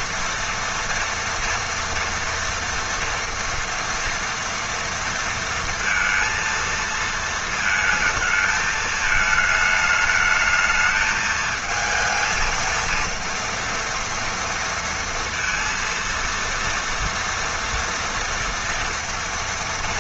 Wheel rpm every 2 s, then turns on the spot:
230, 230, 230, 230, 220, 220, 230, 230, 230, 230.
none